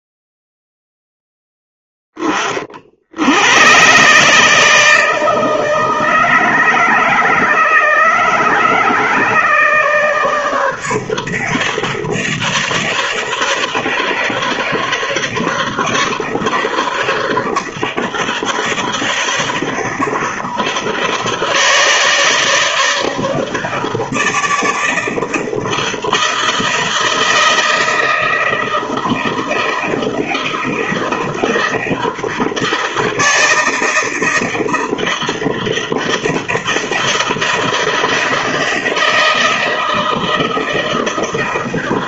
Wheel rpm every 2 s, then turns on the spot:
0, 30, 140, 150, 150, 150, 150, 150, 150, 150, 150, 150, 160, 160, 160, 160, 160, 160, 160, 160, 160.
none